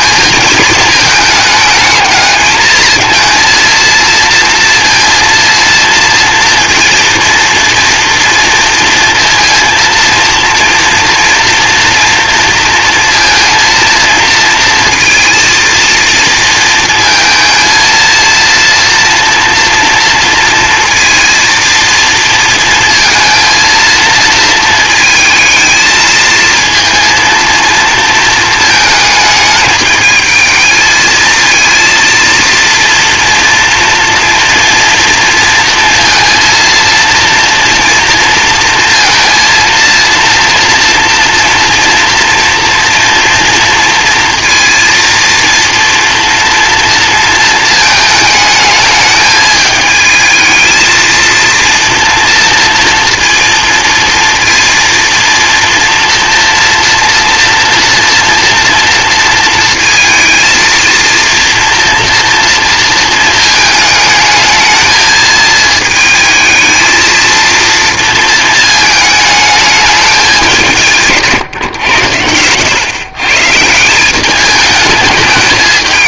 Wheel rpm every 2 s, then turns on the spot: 220, 220, 230, 230, 230, 230, 230, 230, 230, 230, 230, 230, 220, 230, 220, 220, 230, 230, 230, 230, 230, 240, 230, 230, 210, 220, 230, 230, 230, 230, 230, 230, 220, 220, 220, 180, 110, 210.
none